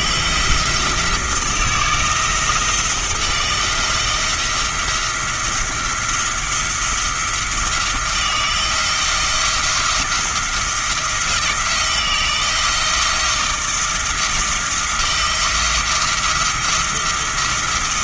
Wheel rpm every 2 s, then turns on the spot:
160, 160, 170, 170, 170, 170, 160, 170, 170.
none